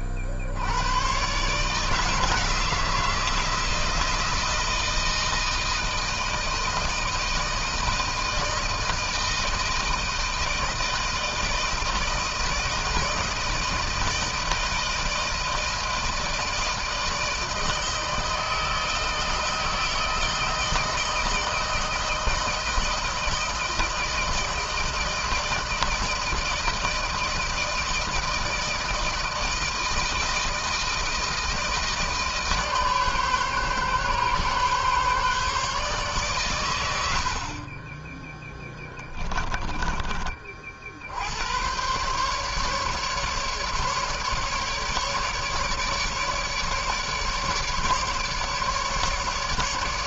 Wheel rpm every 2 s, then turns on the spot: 50, 160, 160, 160, 170, 160, 160, 160, 160, 160, 160, 160, 160, 160, 160, 160, 150, 140, 120, 10, 40, 140, 150, 150, 150.
38-40